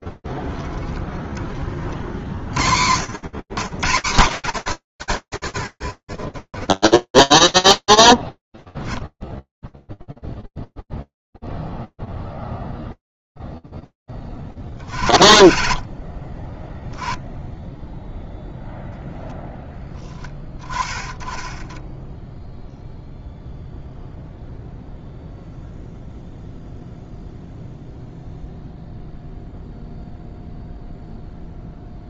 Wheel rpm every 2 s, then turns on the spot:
70, 10, 40, 20, 0, 20, 30, 100, 0, 0, 0, 0, 0, 0, 0, 0.
none